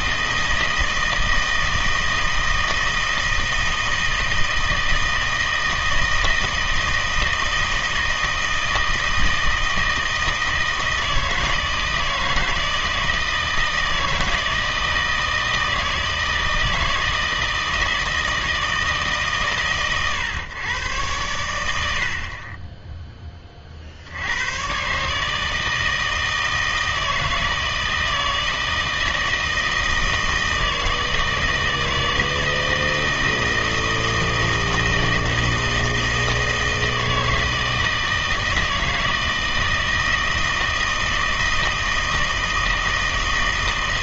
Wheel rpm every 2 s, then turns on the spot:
160, 160, 160, 160, 160, 160, 160, 160, 160, 160, 120, 20, 110, 160, 160, 160, 160, 160, 160, 160, 160, 160.
none